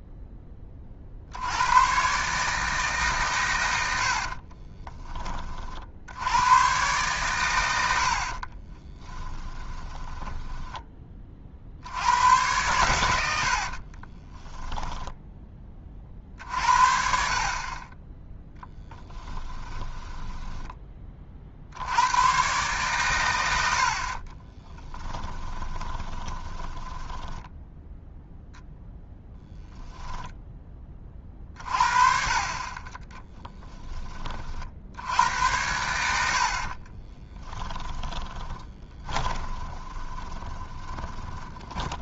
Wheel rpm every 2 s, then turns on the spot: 30, 150, 30, 120, 20, 20, 100, 10, 50, 10, 20, 120, 20, 10, 0, 20, 30, 70, 40, 20, 30.
4-6 8-10 14-16 18-20 24-28 32-34 36-42